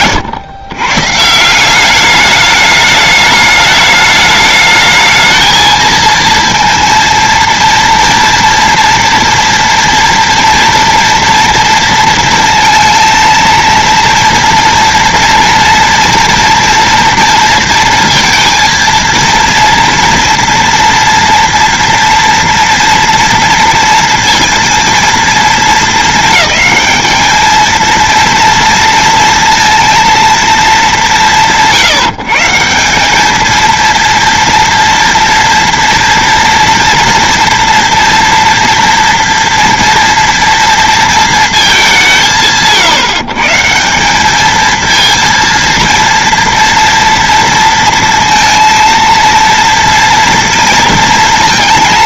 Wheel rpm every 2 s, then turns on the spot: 120, 210, 210, 230, 240, 230, 230, 230, 230, 230, 240, 230, 230, 210, 230, 180, 180, 230, 230, 230, 230, 150, 220, 240, 230, 230.
none